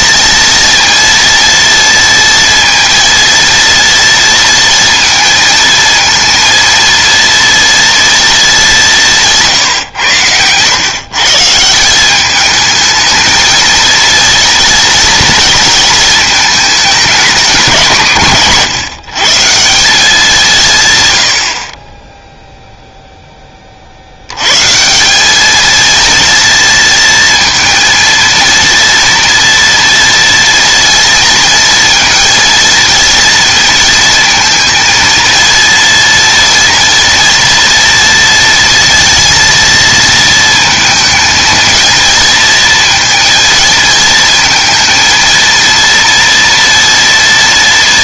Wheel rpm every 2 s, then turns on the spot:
230, 230, 230, 230, 200, 130, 220, 230, 210, 130, 140, 0, 160, 230, 230, 230, 230, 230, 230, 230, 230, 230, 230, 230.
none